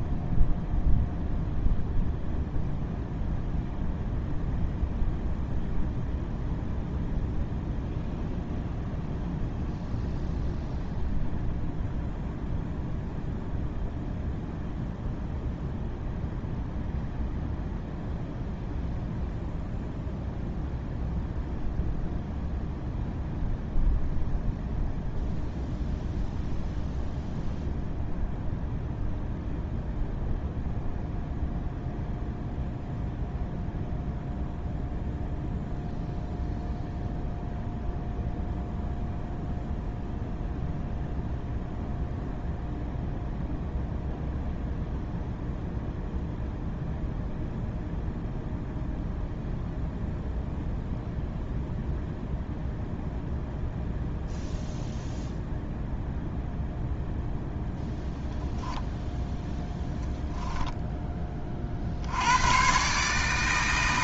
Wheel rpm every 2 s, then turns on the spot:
0, 0, 0, 0, 0, 0, 0, 0, 0, 0, 0, 0, 0, 0, 0, 0, 0, 0, 0, 0, 0, 0, 0, 0, 0, 0, 0, 0, 0, 0, 10, 140.
none